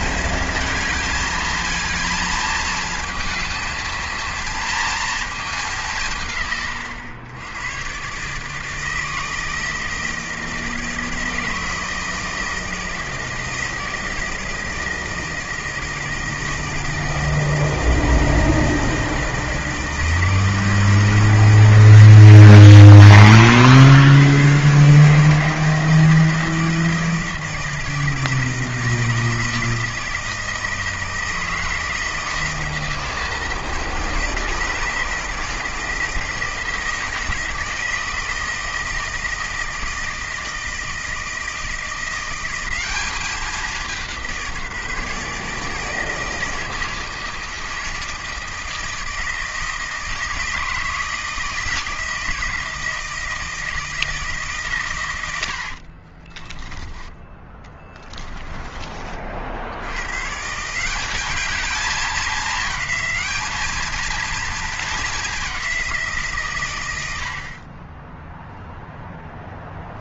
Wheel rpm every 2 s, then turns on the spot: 220, 220, 230, 120, 150, 160, 160, 160, 160, 160, 160, 130, 130, 160, 160, 160, 160, 160, 160, 160, 160, 190, 170, 160, 160, 160, 160, 140, 10, 20, 160, 210, 220, 130, 0.
56-60